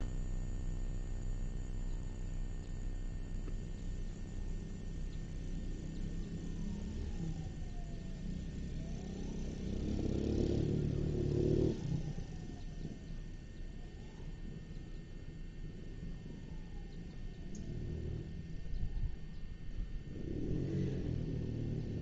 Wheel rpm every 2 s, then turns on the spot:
0, 0, 0, 0, 0, 0, 0, 0, 0, 0, 0.
none